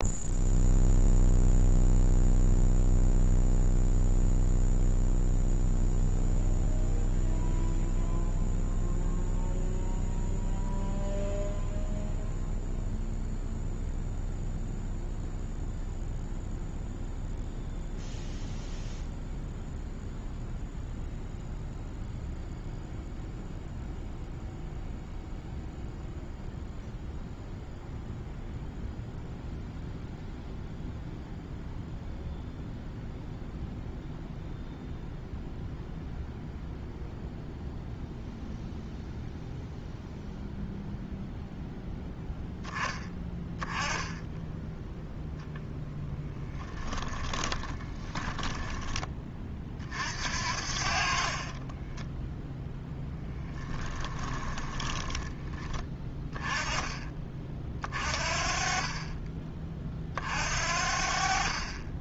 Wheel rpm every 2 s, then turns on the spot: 0, 0, 0, 0, 0, 0, 0, 0, 0, 0, 0, 0, 0, 0, 0, 0, 0, 0, 0, 0, 0, 10, 0, 10, 20, 60, 0, 10, 20, 40, 50.
46-50 54-56